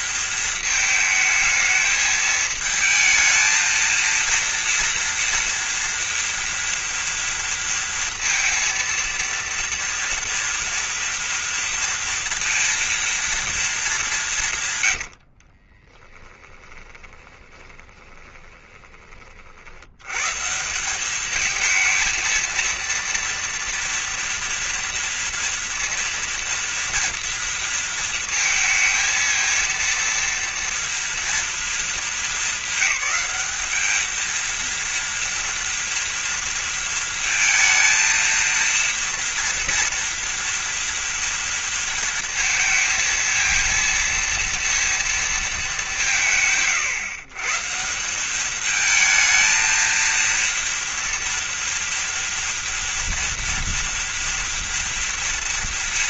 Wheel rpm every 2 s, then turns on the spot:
220, 220, 230, 230, 230, 230, 230, 100, 20, 30, 200, 230, 230, 230, 230, 230, 200, 230, 230, 230, 230, 230, 230, 130, 220, 230, 230, 230.
14-18